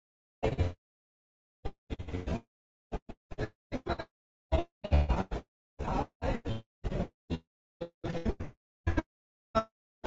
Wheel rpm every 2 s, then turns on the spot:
0, 0, 0, 0, 0.
none